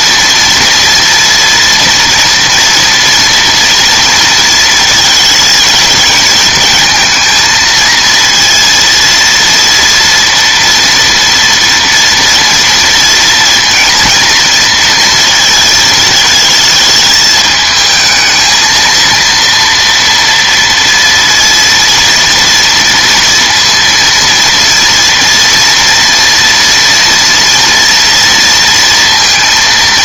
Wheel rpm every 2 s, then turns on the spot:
230, 230, 220, 220, 230, 230, 230, 230, 220, 230, 230, 230, 230, 230, 230.
none